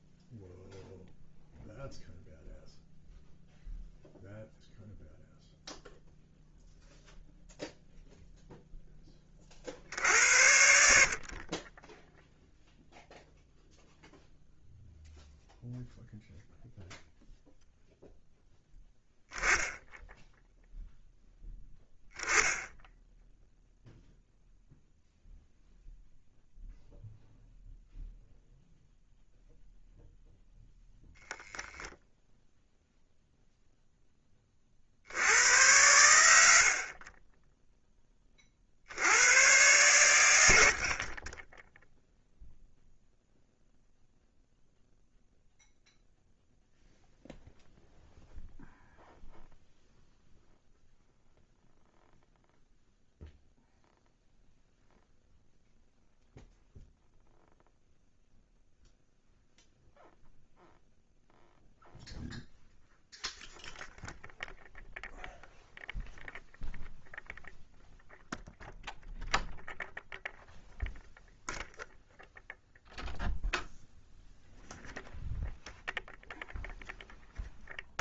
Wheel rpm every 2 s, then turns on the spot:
0, 0, 0, 0, 10, 80, 0, 0, 0, 0, 0, 10, 0, 0, 0, 0, 0, 50, 50, 60, 70, 0, 0, 0, 0, 0, 0, 0, 0, 0, 0, 0, 0, 0, 0, 0, 0, 0, 0.
36-38